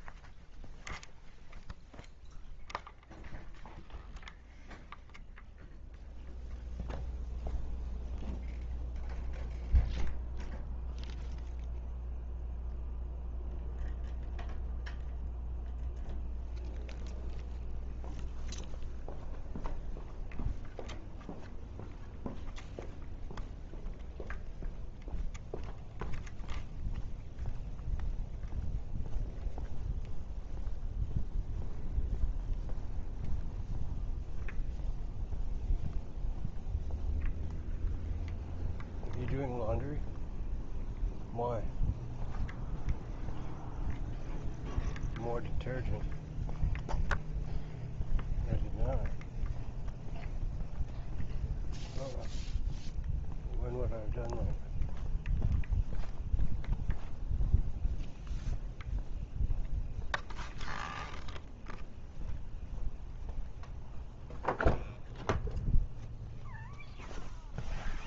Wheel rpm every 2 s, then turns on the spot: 0, 0, 0, 0, 0, 0, 0, 0, 0, 0, 0, 0, 0, 0, 0, 0, 0, 0, 0, 0, 0, 0, 0, 0, 0, 0, 0, 0, 0, 0, 0, 0, 0, 0.
none